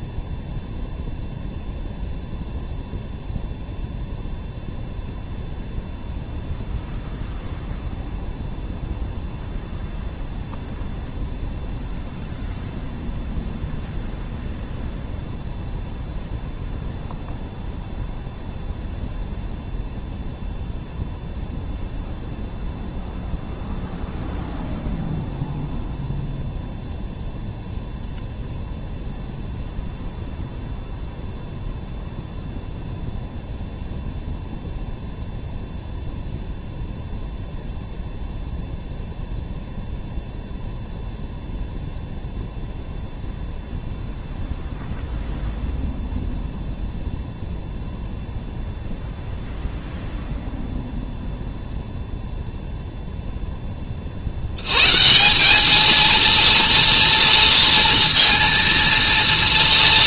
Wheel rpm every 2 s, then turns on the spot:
0, 0, 0, 0, 0, 0, 0, 0, 0, 0, 0, 0, 0, 0, 0, 0, 0, 0, 0, 0, 0, 0, 0, 0, 0, 0, 0, 110, 230, 230.
none